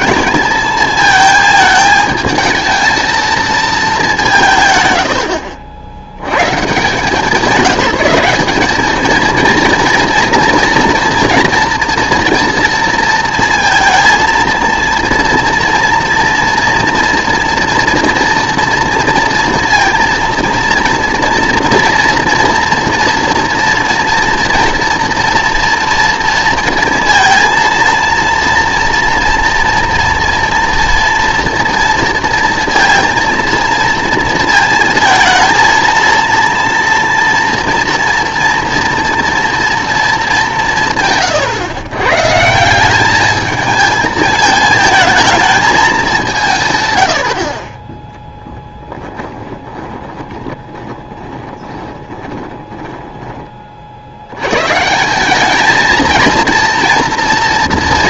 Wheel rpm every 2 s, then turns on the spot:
220, 220, 150, 120, 200, 230, 230, 230, 230, 230, 230, 240, 230, 230, 230, 230, 230, 230, 230, 230, 180, 170, 220, 140, 10, 20, 20, 130, 230.
48-54